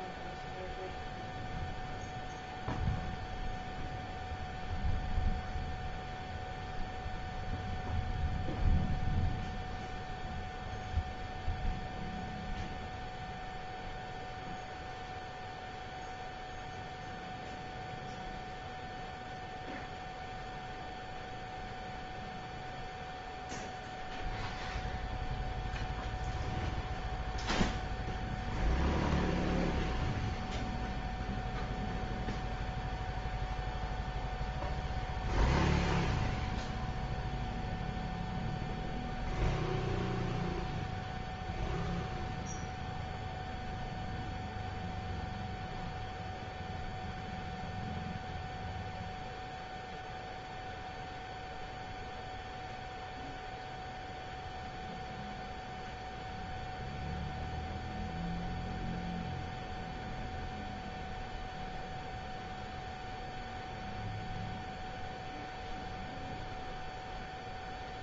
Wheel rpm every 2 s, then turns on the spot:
0, 0, 0, 0, 0, 0, 0, 0, 0, 0, 0, 0, 0, 0, 0, 0, 0, 0, 0, 0, 0, 0, 0, 0, 0, 0, 0, 0, 0, 0, 0, 0, 0, 0.
none